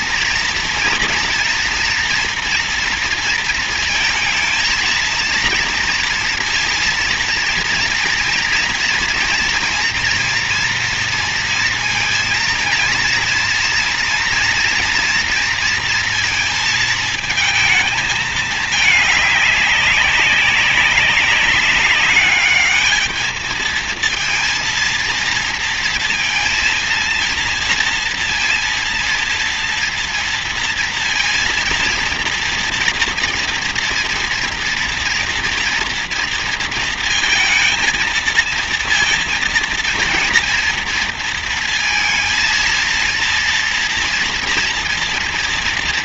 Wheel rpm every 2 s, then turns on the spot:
240, 230, 230, 230, 230, 230, 230, 230, 220, 220, 200, 210, 230, 230, 230, 230, 230, 230, 230, 230, 230, 230, 230.
none